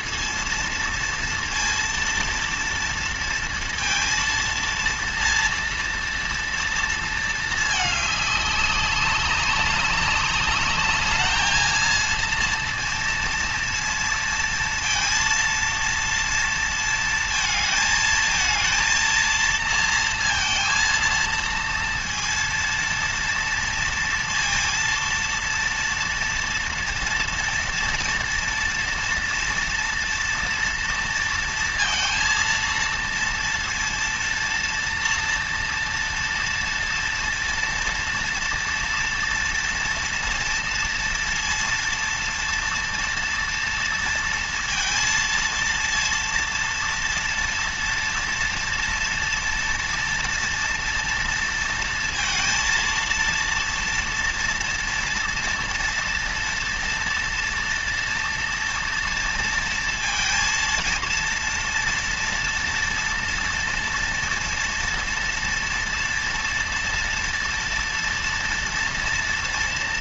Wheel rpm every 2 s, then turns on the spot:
230, 230, 230, 230, 200, 210, 230, 230, 230, 230, 230, 230, 230, 240, 240, 230, 230, 230, 230, 230, 230, 230, 230, 240, 230, 230, 230, 230, 230, 230, 230, 230, 230, 230, 230.
none